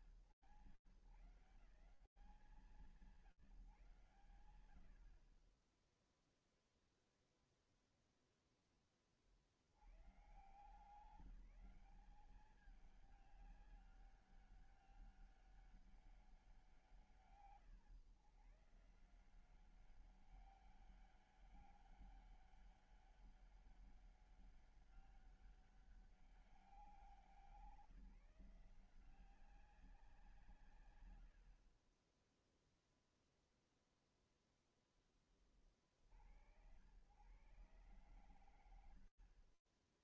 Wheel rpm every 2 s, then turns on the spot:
110, 180, 50, 0, 80, 200, 200, 200, 130, 190, 200, 200, 200, 170, 190, 30, 0, 50, 120, 10.
38-40